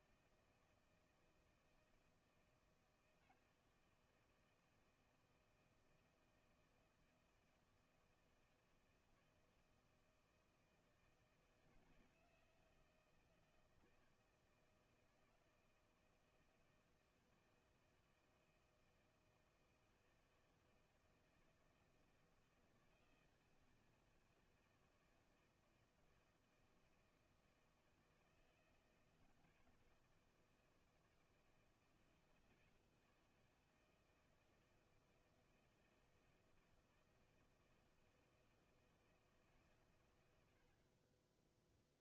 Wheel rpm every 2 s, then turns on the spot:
160, 160, 160, 160, 160, 160, 160, 160, 160, 160, 160, 160, 160, 160, 160, 160, 160, 160, 170, 170, 70.
none